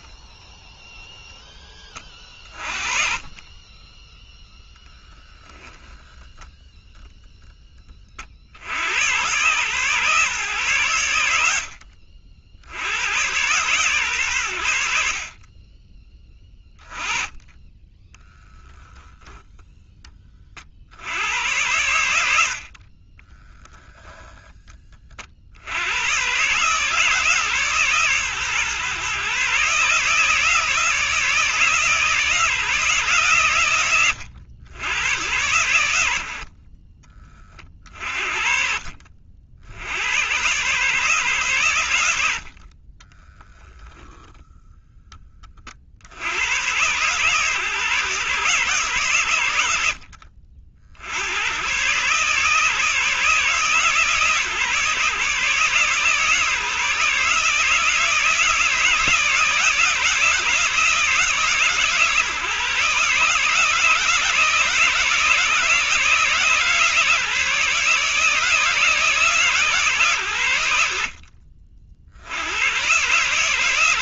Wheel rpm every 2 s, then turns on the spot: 0, 30, 10, 10, 90, 100, 100, 60, 20, 0, 90, 30, 30, 150, 130, 160, 140, 100, 30, 50, 140, 30, 10, 130, 130, 70, 150, 150, 160, 160, 160, 150, 160, 150, 150, 60, 130.
4-6 42-44